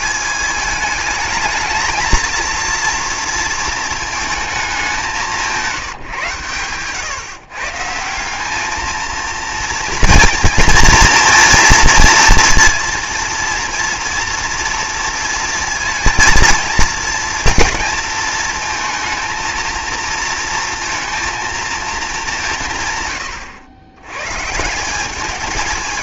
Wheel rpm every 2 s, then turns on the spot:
220, 230, 190, 130, 230, 240, 230, 230, 230, 230, 230, 120, 190.
none